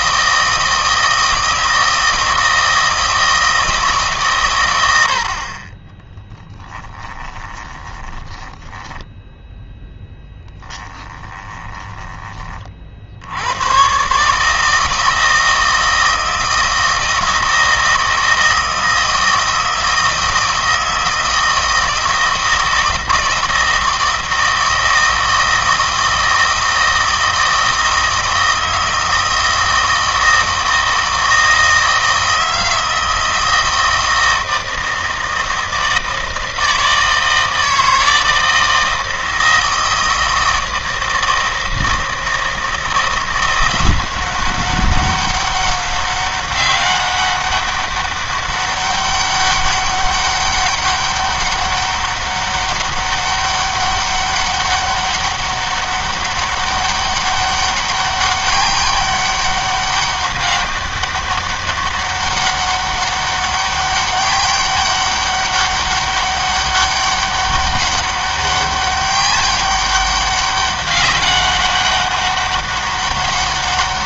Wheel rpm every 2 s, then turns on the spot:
160, 160, 100, 10, 20, 10, 30, 150, 160, 160, 160, 160, 160, 160, 160, 160, 160, 160, 160, 160, 160, 160, 190, 200, 200, 200, 200, 200, 200, 200, 200, 200, 200, 200, 200, 200, 200.
6-12